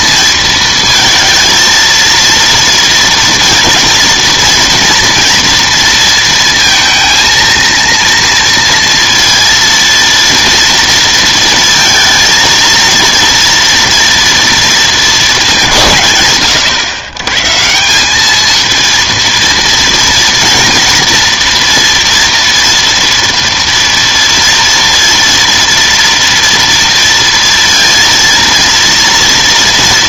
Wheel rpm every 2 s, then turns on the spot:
220, 230, 230, 230, 230, 230, 230, 230, 120, 230, 230, 230, 230, 230, 230.
none